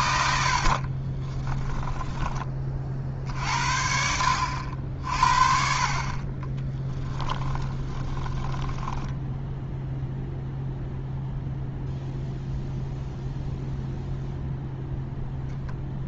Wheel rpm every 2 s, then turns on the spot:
50, 30, 60, 20, 10, 0, 0, 0.
0-2 6-10